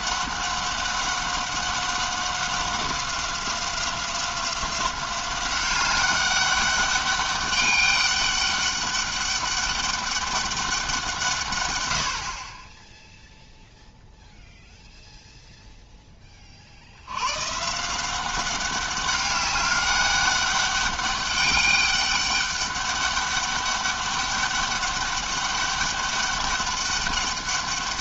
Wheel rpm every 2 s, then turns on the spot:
190, 190, 180, 200, 200, 190, 20, 0, 50, 190, 200, 200, 200, 200.
none